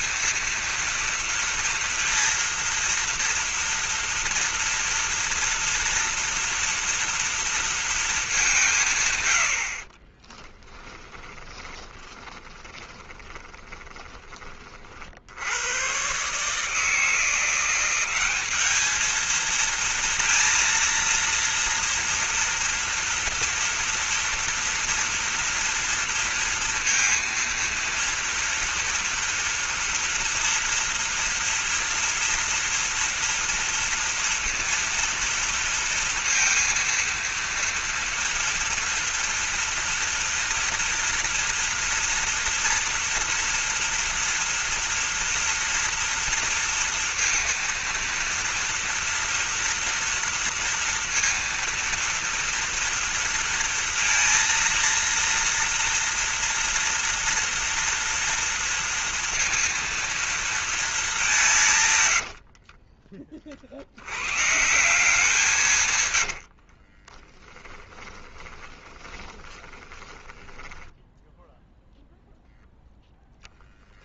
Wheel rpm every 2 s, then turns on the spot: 230, 230, 230, 230, 60, 20, 20, 110, 180, 230, 230, 240, 230, 230, 230, 230, 230, 230, 230, 230, 230, 230, 230, 230, 230, 230, 230, 230, 230, 230, 210, 40, 170, 40, 20, 10, 0.
10-14 62-64 66-72